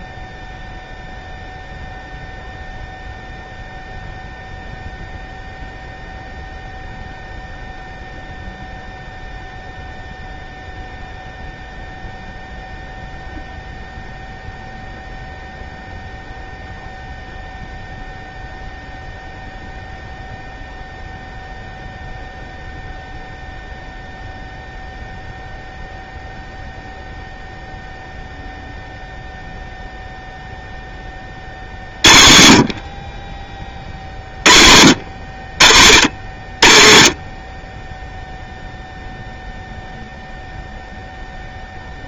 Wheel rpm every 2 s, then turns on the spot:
0, 0, 0, 0, 0, 0, 0, 0, 0, 0, 0, 0, 0, 0, 0, 0, 60, 40, 50, 0, 0.
none